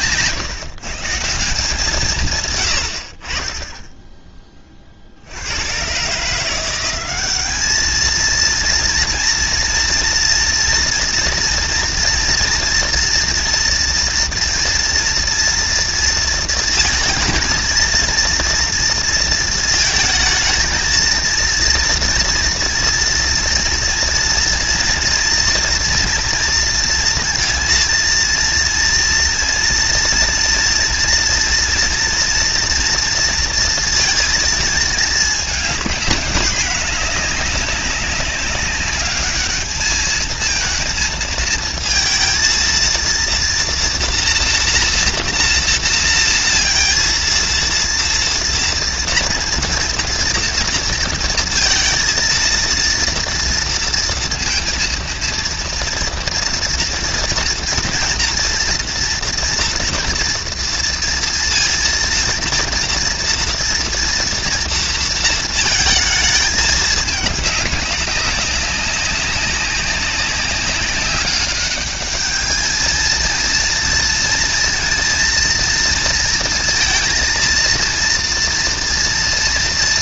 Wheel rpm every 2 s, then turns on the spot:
160, 60, 40, 180, 230, 230, 230, 240, 230, 230, 220, 230, 230, 230, 230, 230, 230, 220, 210, 200, 230, 230, 230, 230, 230, 230, 230, 230, 230, 230, 230, 230, 230, 210, 190, 190, 220, 230, 230, 230.
none